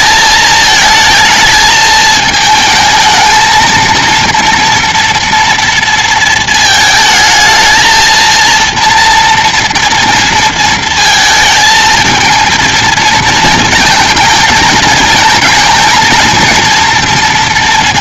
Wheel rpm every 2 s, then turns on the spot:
220, 220, 230, 220, 230, 230, 230, 220, 230.
none